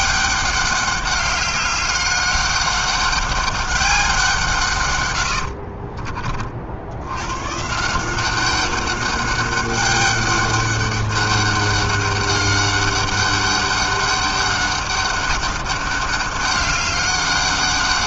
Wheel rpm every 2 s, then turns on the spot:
200, 200, 140, 70, 190, 200, 200, 200, 200.
none